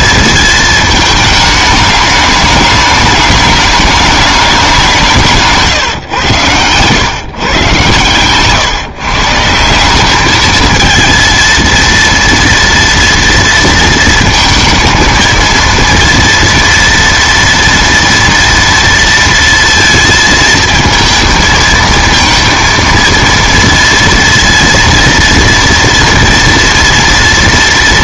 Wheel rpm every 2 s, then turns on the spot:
220, 210, 190, 120, 140, 220, 230, 230, 230, 230, 220, 230, 230, 230.
none